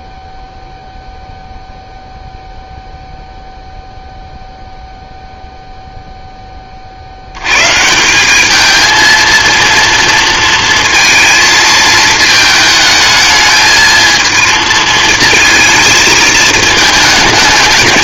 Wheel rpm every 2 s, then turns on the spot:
0, 0, 0, 80, 230, 230, 220, 230, 220.
none